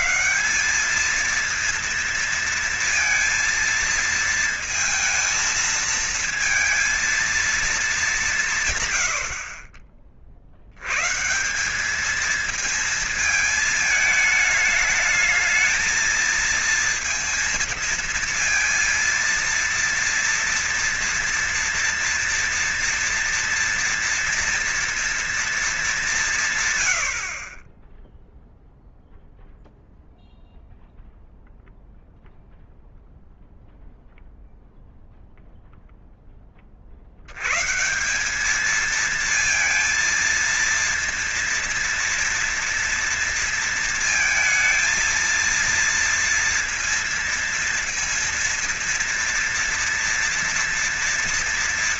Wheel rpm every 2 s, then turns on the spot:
200, 230, 230, 230, 150, 80, 220, 220, 230, 230, 230, 230, 240, 140, 0, 0, 0, 0, 20, 200, 230, 230, 220, 230, 230, 230.
none